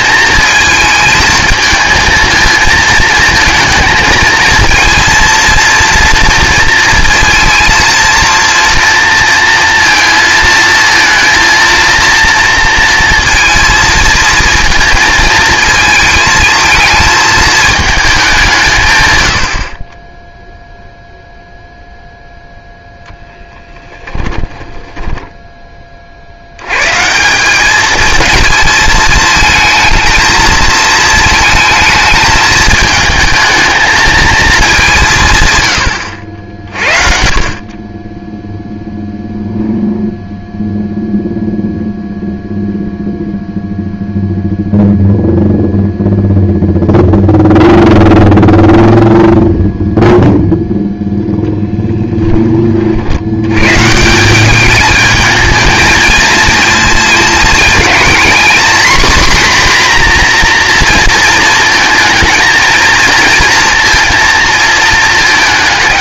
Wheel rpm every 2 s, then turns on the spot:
220, 220, 230, 230, 230, 230, 230, 230, 220, 140, 0, 0, 10, 120, 220, 230, 220, 180, 50, 0, 0, 0, 0, 0, 0, 0, 40, 210, 230, 250, 230, 230, 230.
24-26